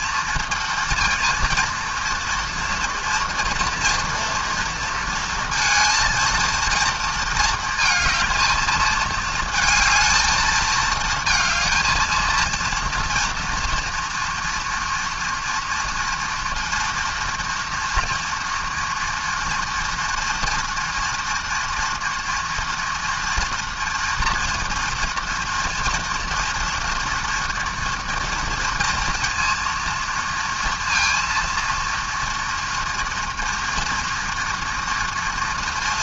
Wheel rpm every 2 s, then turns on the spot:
230, 230, 230, 230, 220, 220, 230, 230, 230, 230, 230, 240, 230, 230, 230, 230, 230, 230.
none